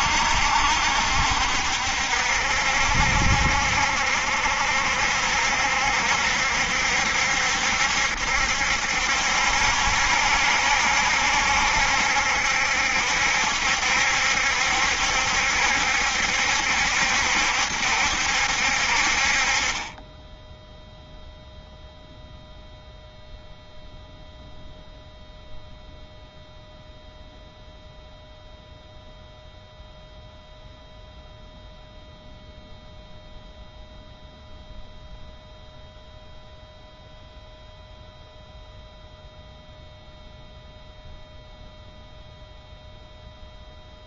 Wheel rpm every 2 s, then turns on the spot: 60, 60, 60, 70, 70, 70, 70, 70, 70, 60, 0, 0, 0, 0, 0, 0, 0, 0, 0, 0, 0, 0.
none